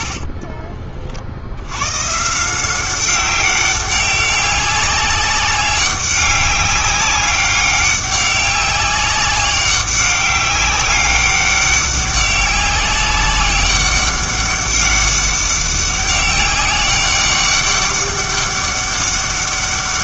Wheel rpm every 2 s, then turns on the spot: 30, 180, 200, 200, 190, 200, 190, 200, 190, 200.
none